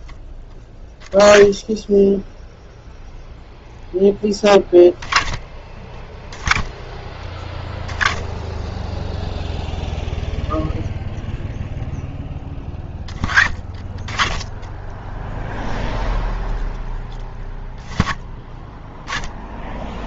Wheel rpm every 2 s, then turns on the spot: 10, 0, 20, 10, 0, 0, 20, 10, 10, 10.
none